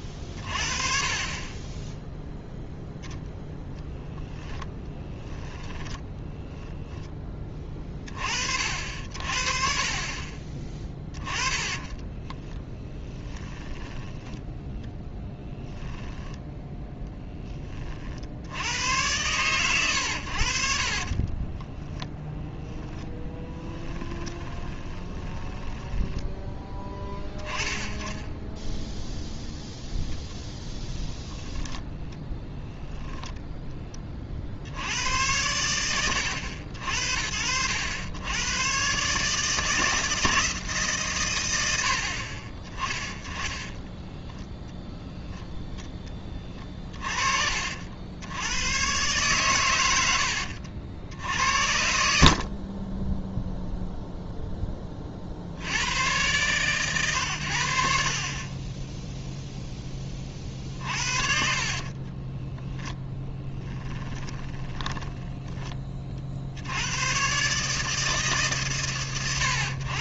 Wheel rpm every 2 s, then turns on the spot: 30, 0, 20, 10, 50, 10, 10, 10, 0, 110, 20, 10, 20, 20, 0, 0, 10, 90, 60, 140, 140, 20, 0, 30, 120, 70, 20, 20, 120, 20, 40, 10, 20, 70, 140.
4-6 10-16 20-26 32-34 60-66